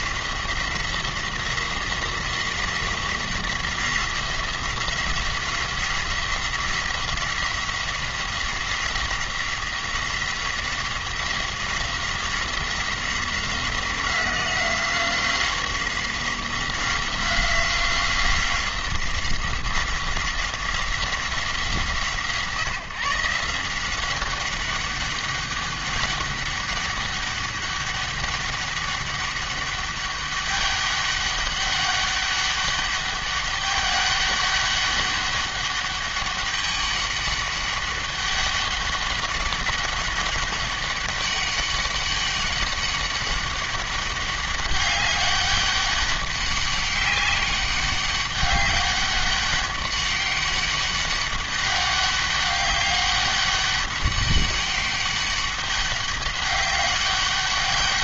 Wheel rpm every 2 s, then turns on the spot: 180, 180, 180, 180, 180, 180, 180, 180, 180, 180, 190, 150, 200, 200, 200, 200, 200, 200, 200, 200, 200, 200, 200, 200, 200, 200, 200, 200, 200.
none